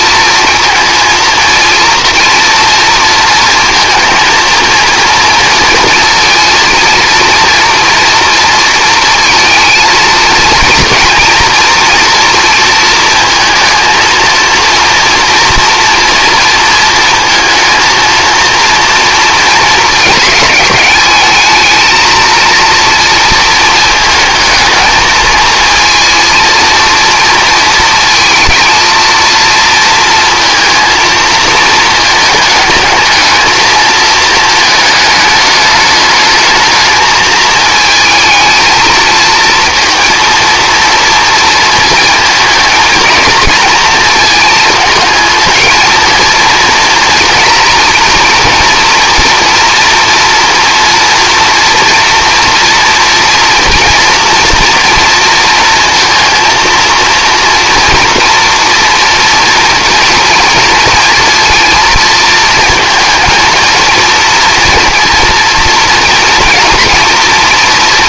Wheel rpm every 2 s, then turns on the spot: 230, 230, 230, 230, 230, 230, 230, 230, 230, 230, 220, 230, 220, 230, 220, 230, 220, 220, 220, 220, 230, 230, 220, 230, 230, 230, 230, 230, 230, 230, 230, 230, 230, 230.
none